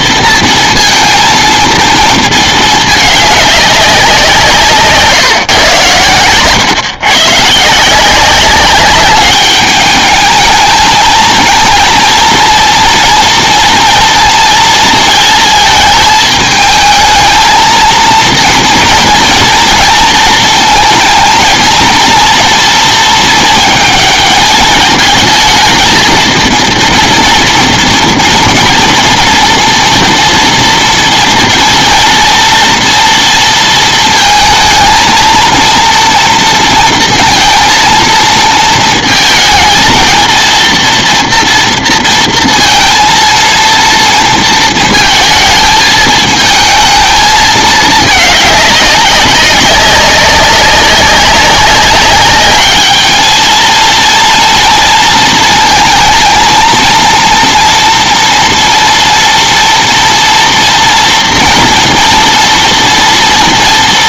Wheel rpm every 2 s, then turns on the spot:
230, 220, 160, 120, 190, 220, 230, 230, 210, 230, 230, 230, 220, 230, 230, 230, 230, 230, 230, 230, 230, 230, 230, 220, 200, 200, 210, 240, 230, 230, 240, 230.
none